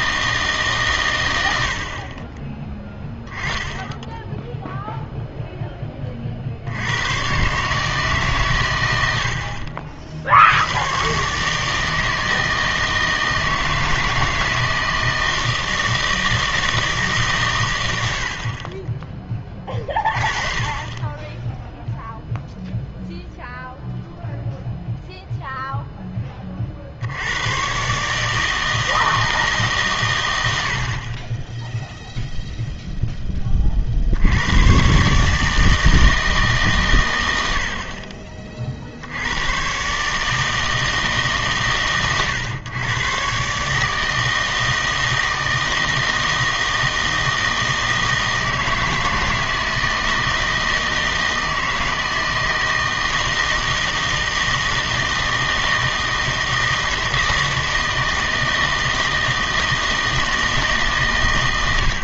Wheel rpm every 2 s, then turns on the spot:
150, 10, 0, 70, 120, 90, 160, 160, 160, 30, 20, 0, 0, 40, 160, 70, 0, 110, 140, 40, 160, 120, 160, 160, 160, 160, 160, 160, 160, 160, 160.
none